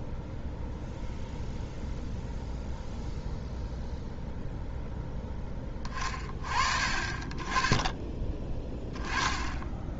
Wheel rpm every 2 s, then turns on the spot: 0, 0, 0, 30, 20.
none